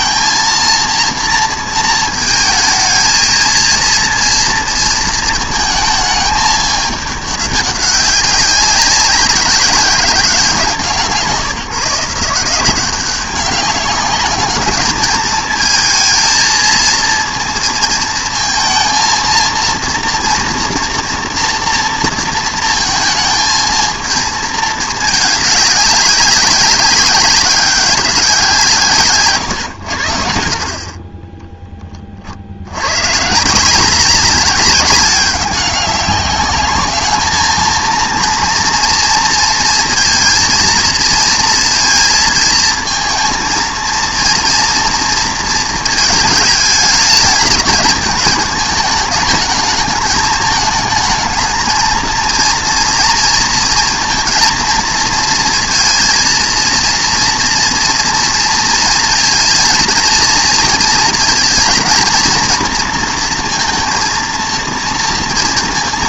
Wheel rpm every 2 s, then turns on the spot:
230, 220, 230, 210, 190, 180, 180, 210, 230, 230, 240, 220, 220, 190, 160, 50, 90, 200, 210, 230, 230, 230, 240, 210, 210, 220, 230, 230, 230, 230, 230, 230, 230.
none